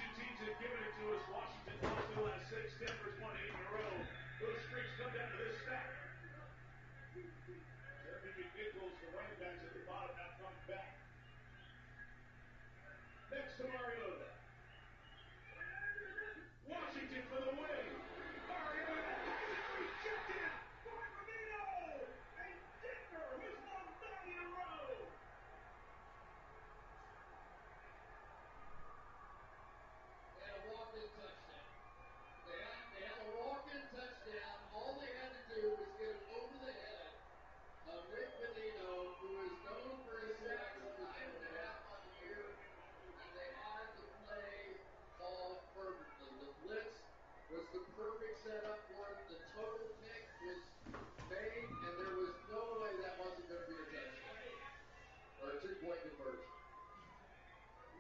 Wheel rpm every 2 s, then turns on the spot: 0, 0, 0, 0, 0, 0, 0, 0, 0, 0, 0, 0, 0, 0, 0, 0, 0, 0, 0, 0, 0, 0, 0, 0, 0, 0, 0, 0, 0.
none